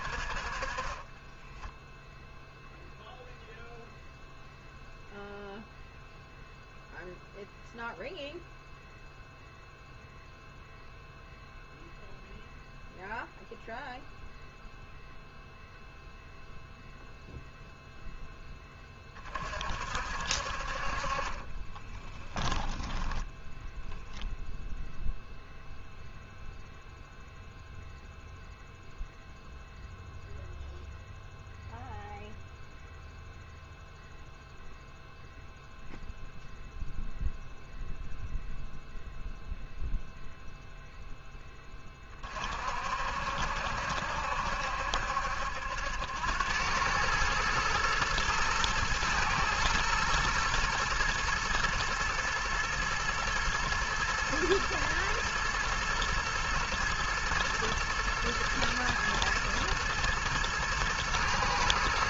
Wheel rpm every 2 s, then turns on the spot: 30, 0, 0, 0, 0, 0, 0, 0, 0, 10, 50, 10, 0, 0, 0, 0, 0, 0, 0, 0, 0, 50, 70, 100, 110, 120, 110, 110, 110, 110, 110.
none